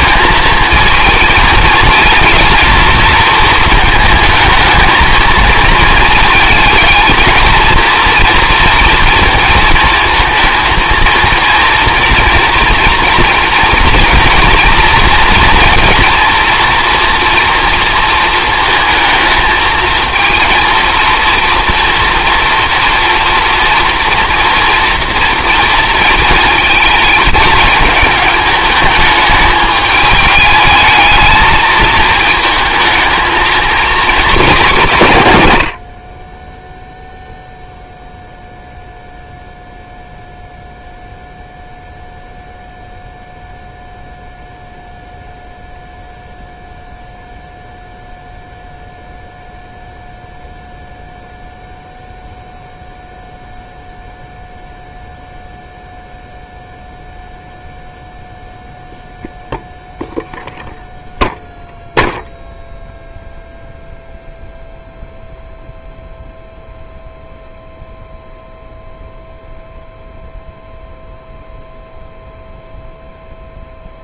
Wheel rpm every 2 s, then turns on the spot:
220, 230, 220, 220, 230, 220, 230, 230, 230, 220, 230, 230, 230, 210, 210, 220, 220, 140, 0, 0, 0, 0, 0, 0, 0, 0, 0, 0, 0, 0, 0, 0, 0, 0, 0, 0, 0.
none